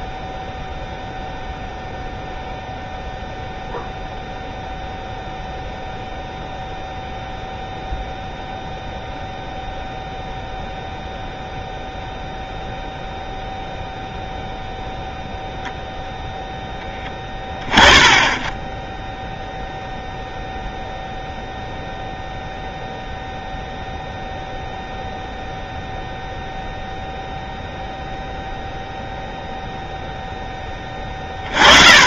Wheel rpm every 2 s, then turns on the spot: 0, 0, 0, 0, 0, 0, 0, 0, 10, 10, 0, 0, 0, 0, 0, 10.
none